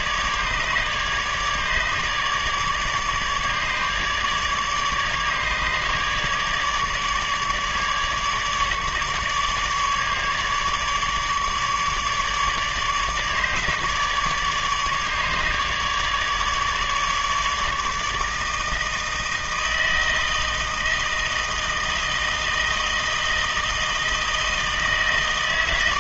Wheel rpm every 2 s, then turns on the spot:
150, 150, 150, 150, 150, 150, 150, 150, 150, 160, 160, 160, 160.
none